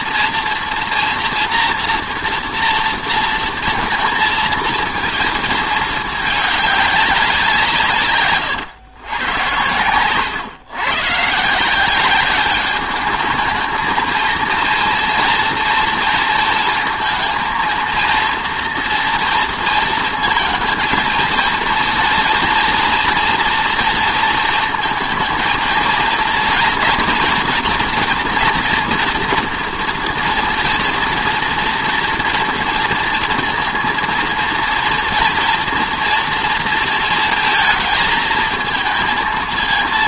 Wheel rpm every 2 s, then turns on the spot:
230, 230, 230, 210, 130, 120, 200, 230, 230, 230, 220, 240, 230, 230, 240, 230, 230, 230, 230, 220.
none